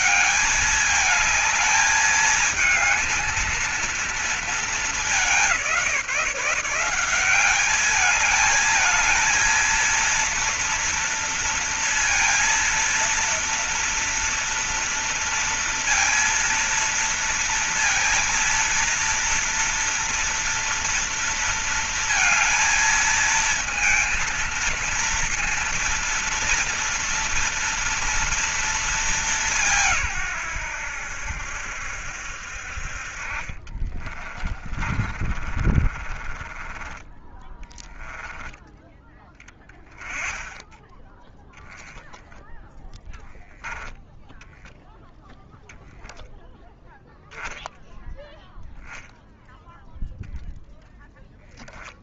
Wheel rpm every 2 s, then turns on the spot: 210, 220, 230, 180, 210, 230, 230, 230, 230, 230, 230, 230, 230, 230, 230, 140, 70, 30, 20, 20, 20, 0, 10, 20, 0, 0.
34-38